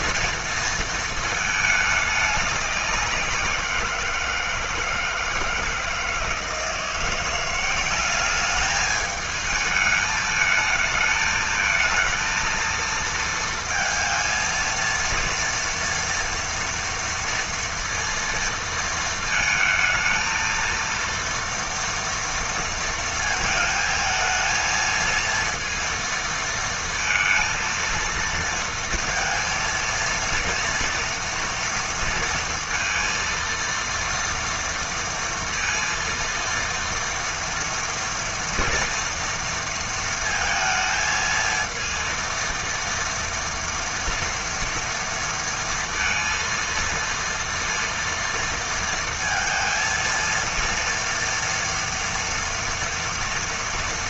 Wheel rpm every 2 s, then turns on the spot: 230, 200, 160, 170, 210, 220, 230, 230, 230, 230, 230, 230, 220, 230, 230, 230, 230, 230, 230, 240, 230, 230, 230, 230, 230, 230, 230.
none